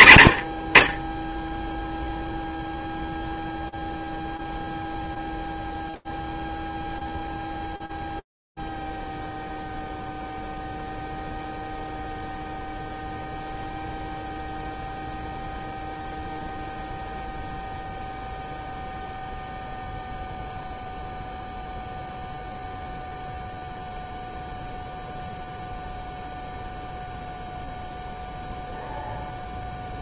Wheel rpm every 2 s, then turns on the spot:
40, 0, 0, 0, 0, 0, 0, 0, 0, 0, 0, 0, 0, 0, 0.
none